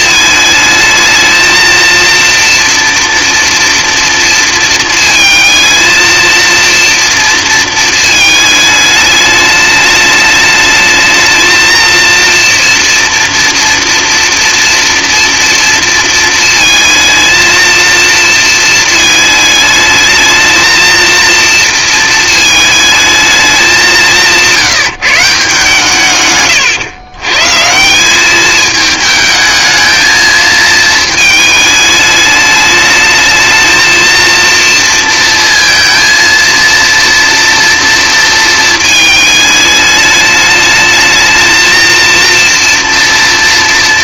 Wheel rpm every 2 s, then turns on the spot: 220, 230, 230, 230, 220, 220, 240, 230, 230, 220, 220, 220, 160, 120, 210, 220, 210, 230, 230, 220, 210, 230.
none